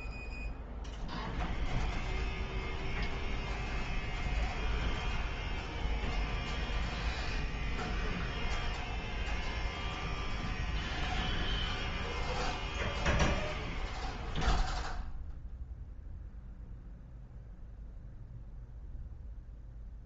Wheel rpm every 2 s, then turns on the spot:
0, 0, 0, 0, 0, 0, 0, 0, 0, 0.
none